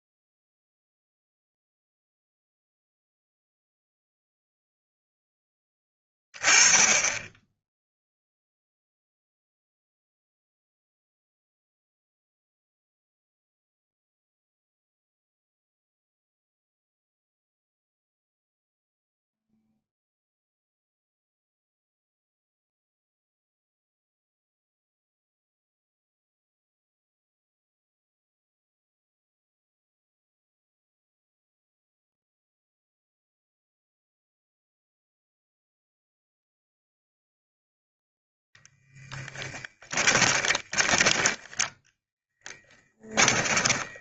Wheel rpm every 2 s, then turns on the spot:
0, 0, 0, 10, 0, 0, 0, 0, 0, 0, 0, 0, 0, 0, 0, 0, 0, 0, 0, 10, 10, 20.
40-44